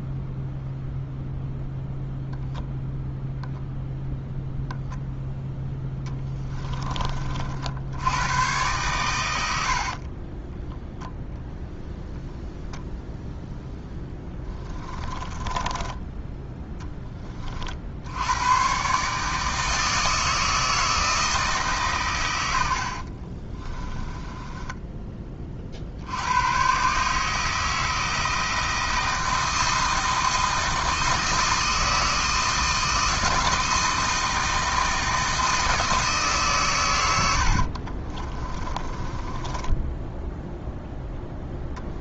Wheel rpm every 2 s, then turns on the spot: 0, 0, 0, 20, 110, 0, 0, 10, 10, 130, 160, 70, 20, 130, 160, 160, 160, 160, 120, 20, 0.
22-26 38-40